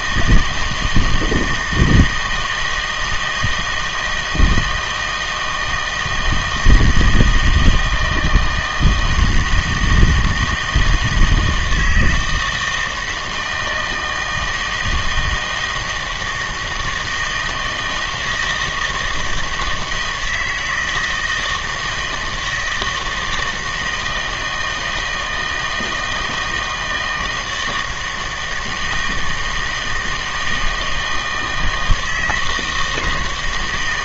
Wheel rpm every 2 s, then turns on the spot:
160, 160, 160, 160, 170, 160, 160, 160, 160, 160, 160, 160, 160, 160, 160, 160, 160.
none